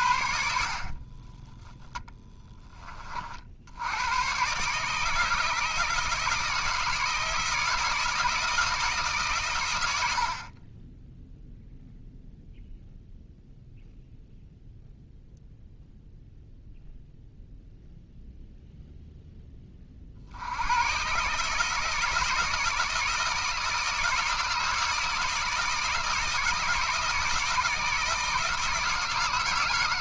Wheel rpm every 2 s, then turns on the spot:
60, 30, 150, 160, 160, 20, 0, 0, 0, 0, 110, 160, 160, 160, 160.
0-2